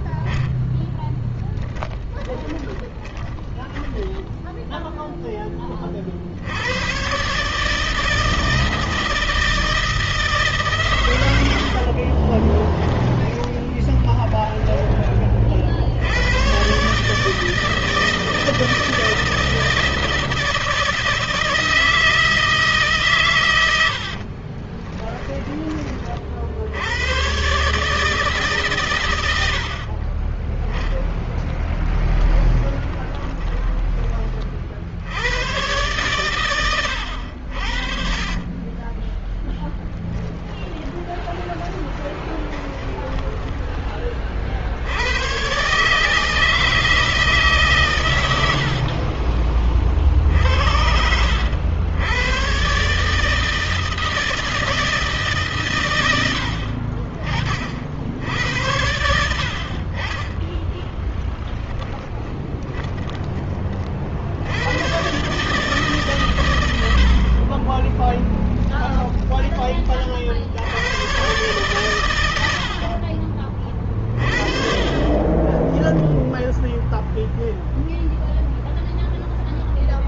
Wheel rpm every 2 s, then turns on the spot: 10, 10, 0, 110, 160, 130, 10, 30, 140, 160, 160, 140, 20, 90, 120, 10, 20, 70, 100, 20, 10, 20, 90, 160, 50, 70, 140, 160, 60, 70, 0, 20, 110, 70, 10, 110, 50, 20, 0, 0.
0-4 12-14 24-26 32-34 36-44 48-50 62-64